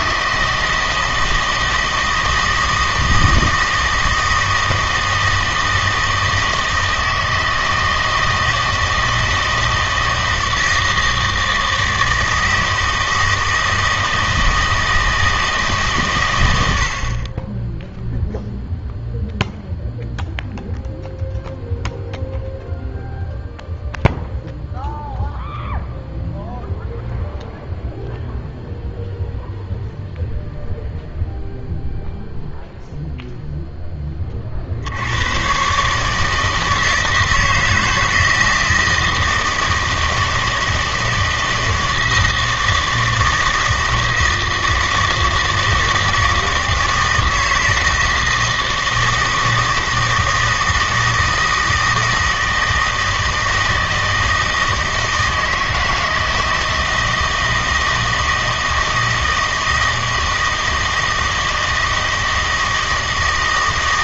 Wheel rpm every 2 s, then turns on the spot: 160, 160, 160, 160, 160, 160, 160, 160, 90, 0, 0, 0, 0, 0, 0, 0, 0, 60, 160, 160, 160, 160, 160, 160, 160, 160, 160, 160, 160, 160, 160, 160.
none